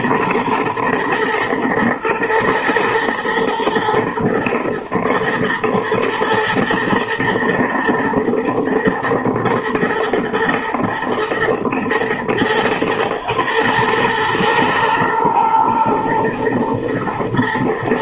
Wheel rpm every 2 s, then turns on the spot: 110, 110, 120, 110, 110, 120, 110, 110, 120.
none